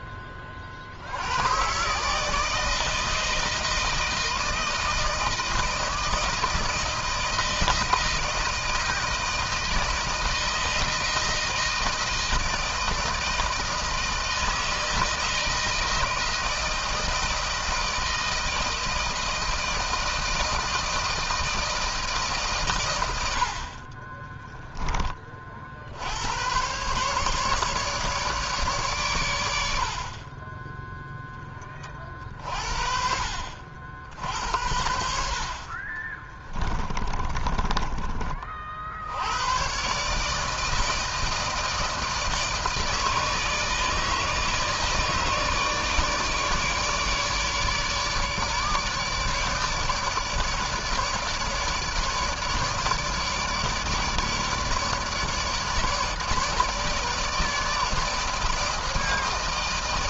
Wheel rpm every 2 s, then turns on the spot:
70, 160, 160, 160, 170, 160, 160, 160, 160, 160, 160, 100, 20, 120, 130, 10, 50, 70, 20, 60, 160, 160, 160, 150, 150, 150, 150, 150, 150, 160.
36-38